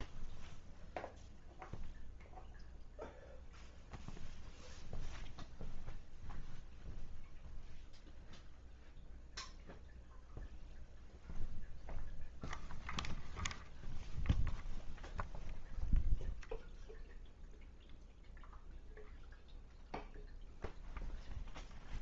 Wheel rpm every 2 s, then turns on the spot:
0, 0, 0, 0, 0, 0, 0, 0, 0, 0, 0.
none